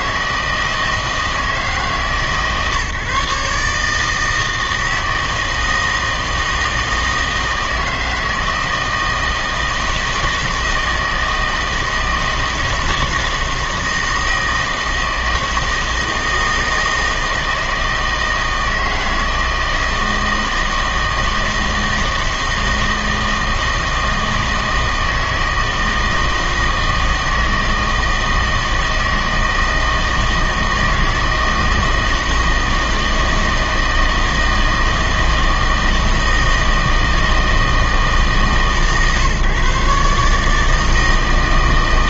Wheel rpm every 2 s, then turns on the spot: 160, 140, 160, 160, 160, 160, 160, 160, 160, 160, 160, 160, 160, 160, 160, 160, 160, 160, 160, 150, 160.
none